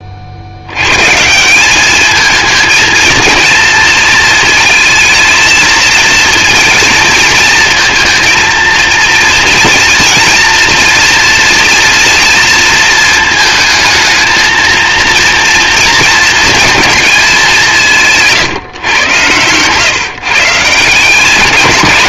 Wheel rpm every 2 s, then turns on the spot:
110, 230, 230, 220, 230, 230, 220, 230, 230, 120, 180.
none